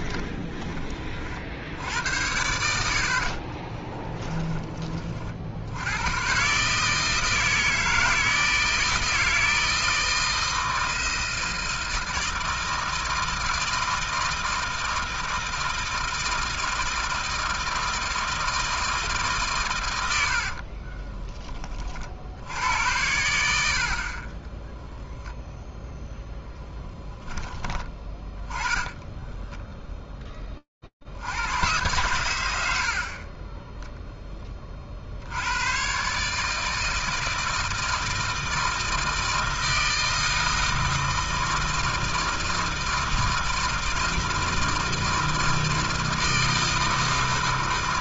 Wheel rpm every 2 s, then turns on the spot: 70, 20, 50, 160, 160, 160, 160, 160, 160, 130, 10, 70, 0, 10, 10, 80, 20, 90, 160, 160, 160, 160, 160, 160.
2-4 28-30